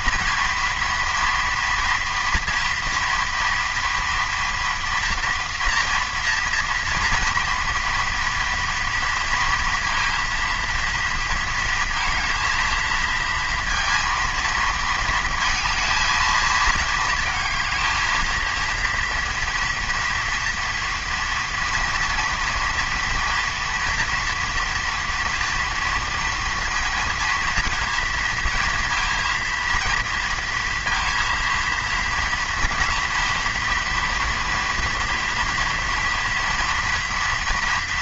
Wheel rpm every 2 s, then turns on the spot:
230, 230, 240, 240, 230, 230, 230, 230, 220, 230, 230, 230, 230, 230, 230, 230, 240, 240, 240.
none